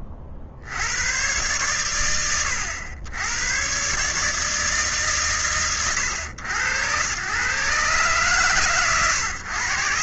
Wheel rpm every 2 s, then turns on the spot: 50, 80, 150, 100, 120.
none